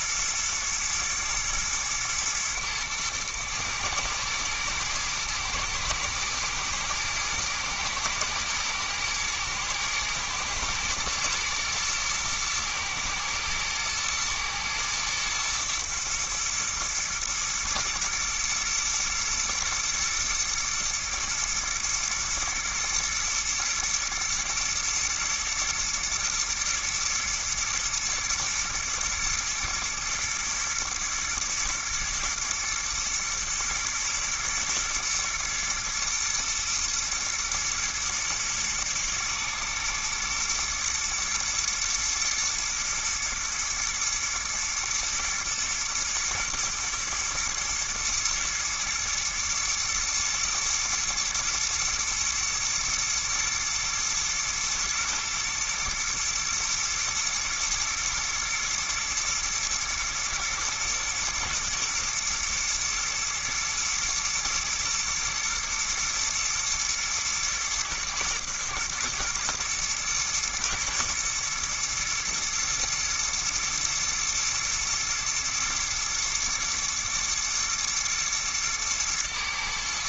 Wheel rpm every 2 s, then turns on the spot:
120, 110, 110, 110, 110, 120, 110, 110, 110, 110, 110, 110, 110, 120, 120, 120, 110, 120, 120, 110, 120, 120, 120, 110, 120, 110, 120, 110, 120, 120, 120, 120, 110, 120, 110, 110, 120, 120, 110, 110.
none